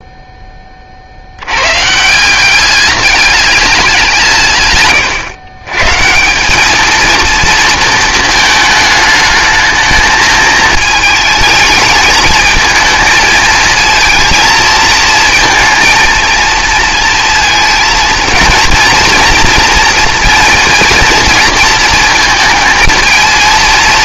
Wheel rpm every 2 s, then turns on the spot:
20, 190, 140, 210, 220, 220, 220, 220, 230, 230, 230, 220.
none